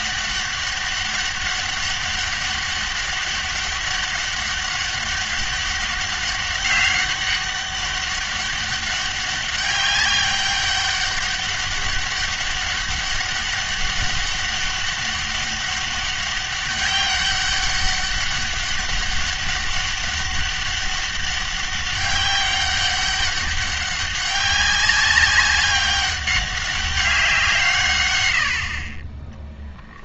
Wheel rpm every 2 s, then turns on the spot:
200, 200, 200, 200, 200, 200, 200, 200, 200, 200, 200, 200, 190, 200, 50.
none